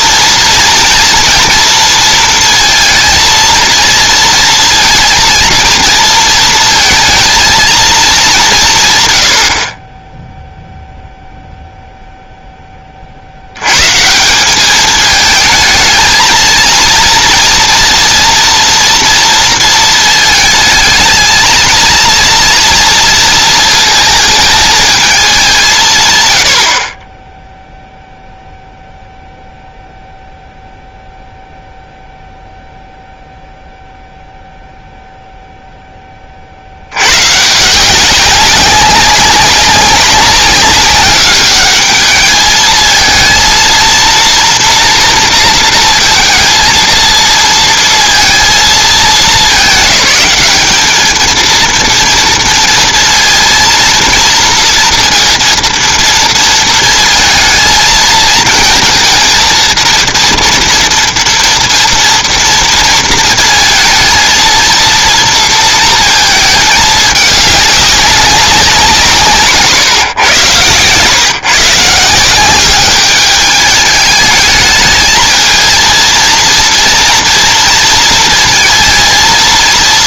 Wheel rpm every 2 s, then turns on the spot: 240, 230, 230, 230, 110, 0, 30, 210, 230, 230, 220, 230, 220, 40, 0, 0, 0, 0, 70, 190, 200, 220, 230, 230, 220, 210, 230, 230, 230, 220, 230, 230, 230, 220, 180, 120, 200, 220, 230, 230.
none